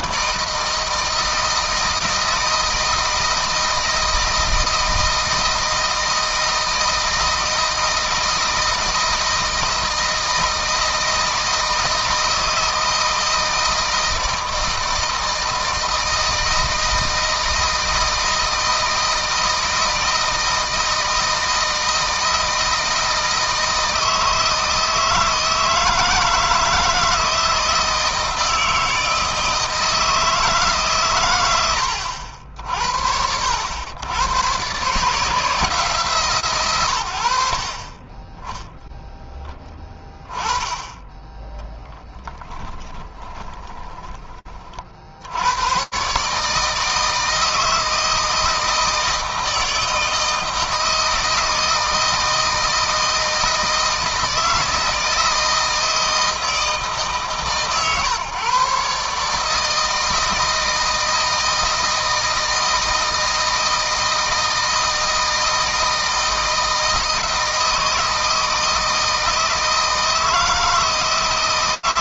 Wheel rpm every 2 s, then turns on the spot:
160, 160, 160, 160, 160, 160, 160, 160, 160, 160, 160, 160, 160, 160, 160, 140, 70, 130, 120, 10, 10, 10, 60, 160, 160, 160, 160, 160, 150, 140, 160, 160, 160, 160, 160, 160.
42-44